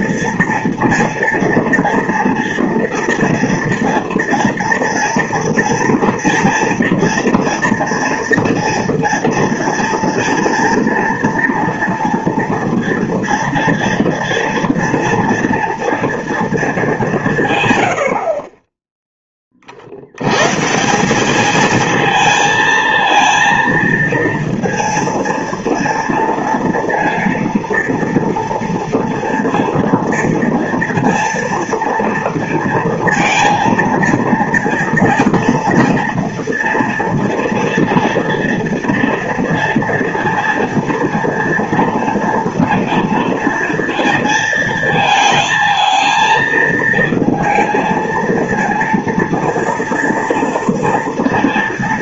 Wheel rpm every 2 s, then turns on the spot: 230, 230, 230, 230, 230, 230, 230, 230, 220, 30, 150, 230, 230, 230, 230, 230, 230, 230, 240, 230, 230, 240, 230, 230, 230, 230.
none